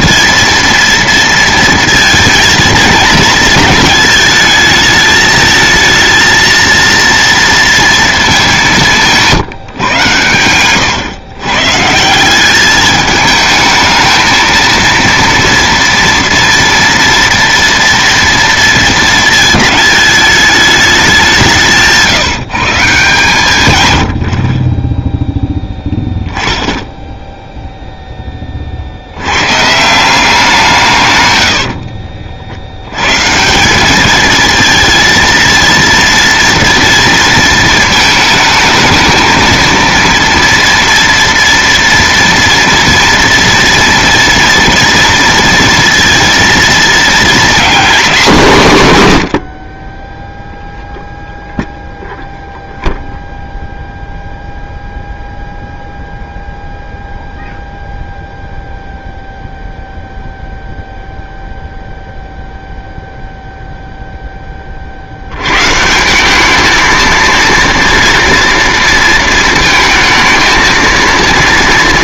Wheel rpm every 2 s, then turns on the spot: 230, 220, 220, 230, 180, 120, 210, 230, 230, 230, 200, 150, 20, 10, 60, 140, 90, 230, 230, 220, 230, 230, 230, 230, 150, 0, 0, 0, 0, 0, 0, 0, 60, 220, 230, 230.
none